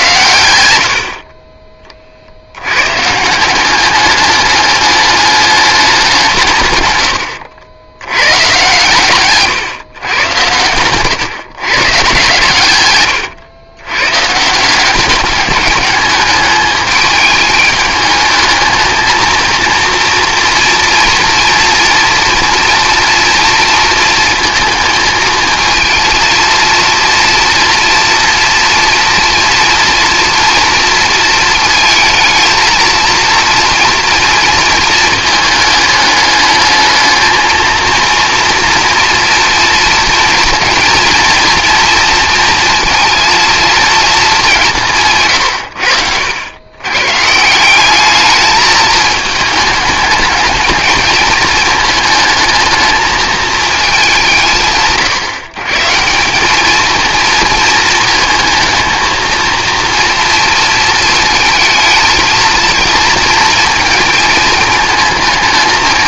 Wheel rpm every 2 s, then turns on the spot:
90, 110, 210, 110, 130, 120, 110, 180, 210, 220, 230, 240, 230, 230, 230, 230, 230, 230, 210, 230, 230, 230, 170, 110, 220, 220, 220, 150, 220, 220, 230, 220, 220.
10-12